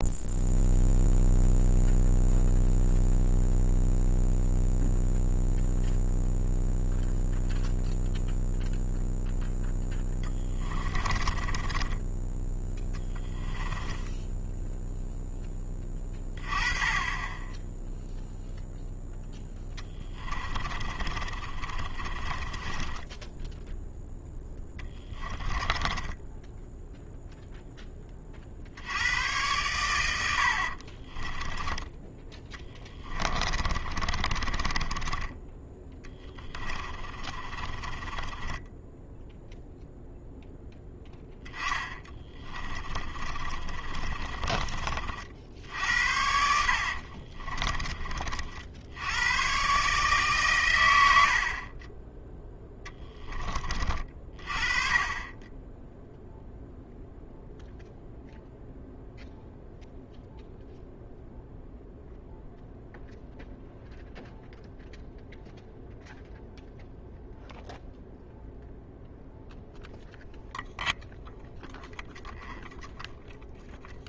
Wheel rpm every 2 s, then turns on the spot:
0, 0, 0, 0, 0, 20, 10, 0, 20, 0, 30, 10, 20, 0, 70, 60, 20, 10, 20, 10, 10, 20, 40, 60, 70, 110, 10, 30, 0, 0, 0, 0, 0, 0, 0, 0, 0.
10-12 20-26 30-40 42-44 46-48